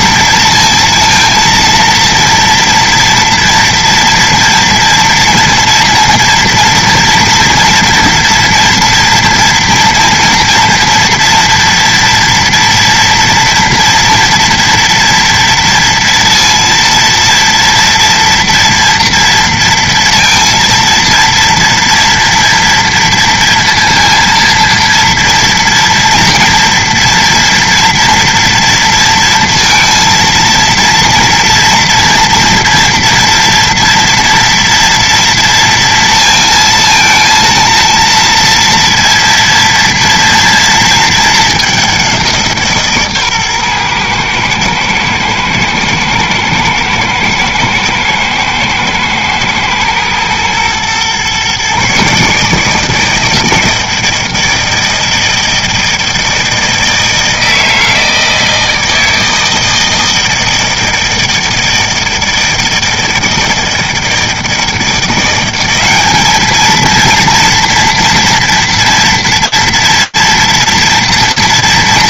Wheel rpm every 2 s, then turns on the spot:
230, 230, 230, 230, 230, 230, 230, 240, 230, 230, 230, 230, 230, 230, 230, 230, 230, 230, 230, 230, 230, 170, 110, 110, 110, 120, 150, 160, 160, 160, 160, 160, 160, 210, 230, 230.
none